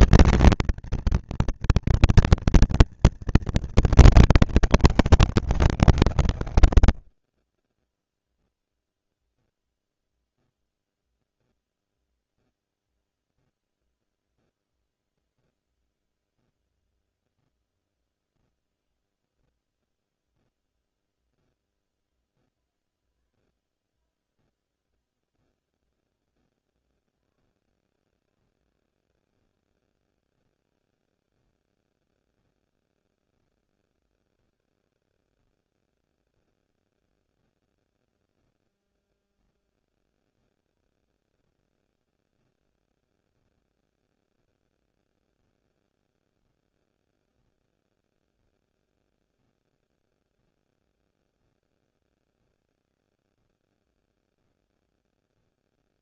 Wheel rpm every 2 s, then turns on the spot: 230, 230, 210, 120, 0, 0, 0, 0, 0, 0, 0, 0, 0, 0, 0, 0, 0, 0, 0, 0, 0, 0, 0, 0, 0, 0, 0, 0.
none